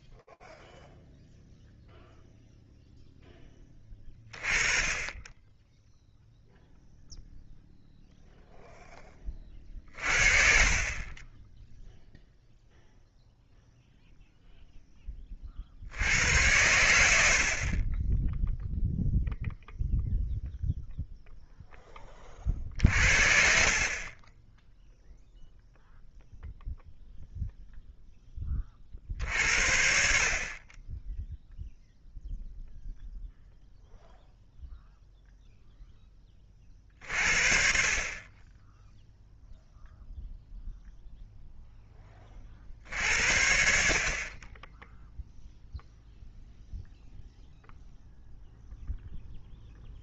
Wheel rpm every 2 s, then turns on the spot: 0, 20, 0, 0, 40, 0, 0, 80, 10, 0, 20, 20, 0, 10, 50, 0, 0, 10, 30, 0, 10, 60, 0, 0, 0.
none